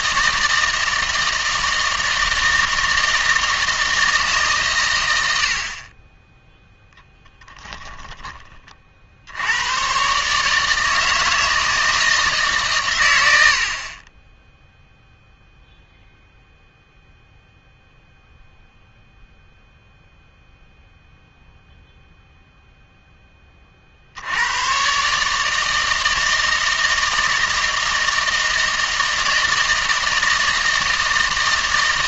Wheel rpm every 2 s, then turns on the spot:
160, 160, 130, 0, 30, 150, 130, 0, 0, 0, 0, 0, 110, 160, 160, 160.
none